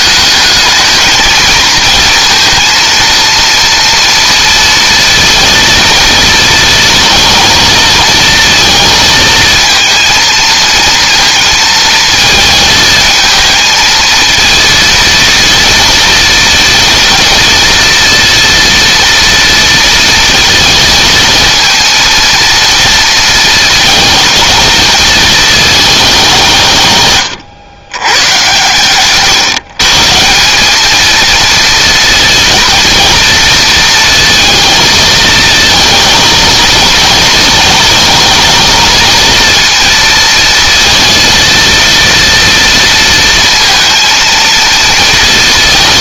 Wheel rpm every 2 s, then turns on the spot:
220, 230, 230, 230, 230, 230, 220, 230, 230, 230, 230, 230, 230, 140, 120, 210, 230, 230, 230, 230, 230, 230, 230.
none